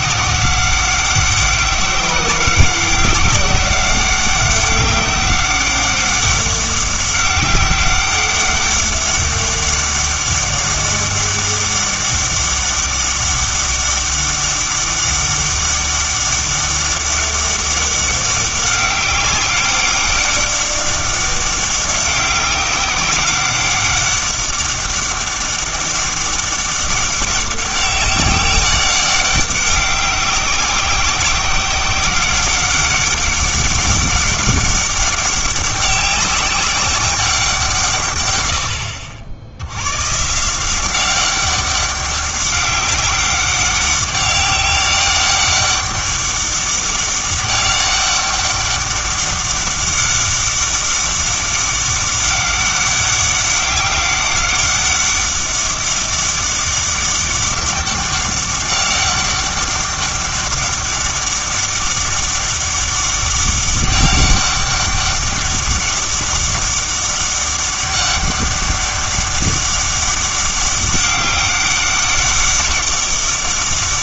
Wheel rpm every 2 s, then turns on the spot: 190, 190, 190, 190, 200, 200, 200, 200, 200, 190, 200, 190, 200, 200, 200, 190, 200, 200, 190, 90, 170, 190, 200, 200, 200, 200, 200, 200, 200, 200, 200, 200, 200, 200, 200, 200, 200.
none